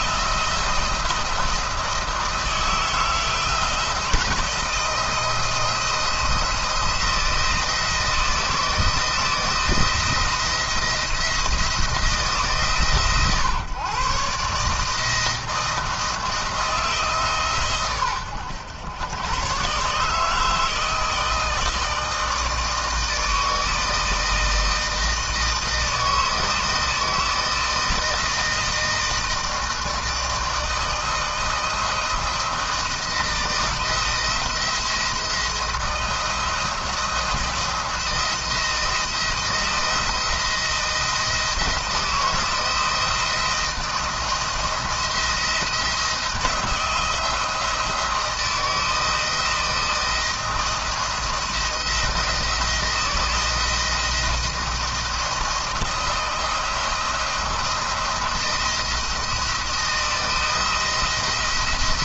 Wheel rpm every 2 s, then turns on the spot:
160, 160, 170, 170, 160, 170, 150, 150, 160, 110, 160, 160, 160, 160, 160, 160, 170, 170, 160, 170, 160, 160, 170, 170, 170, 170, 160, 170, 170, 170, 170.
none